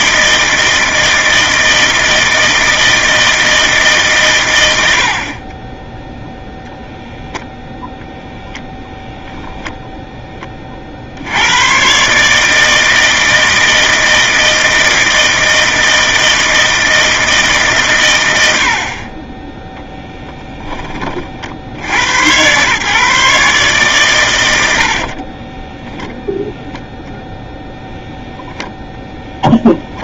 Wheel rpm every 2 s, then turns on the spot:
160, 160, 100, 0, 0, 20, 150, 160, 160, 80, 10, 130, 70, 0, 0.
none